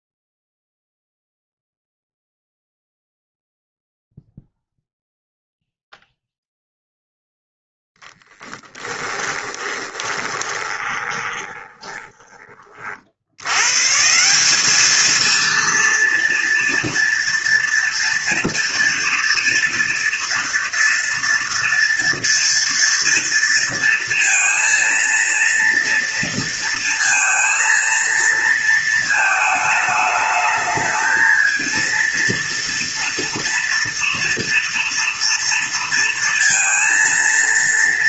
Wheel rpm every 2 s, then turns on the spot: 0, 0, 0, 0, 20, 20, 40, 200, 230, 230, 230, 230, 230, 230, 230, 220, 230, 230, 230.
8-12